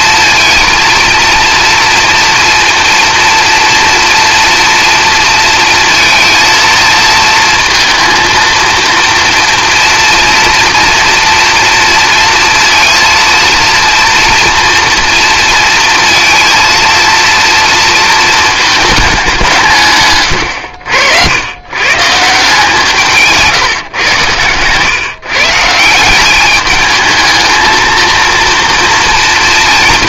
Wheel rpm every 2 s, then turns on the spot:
230, 230, 230, 220, 230, 230, 230, 230, 230, 220, 80, 170, 130, 210, 230.
none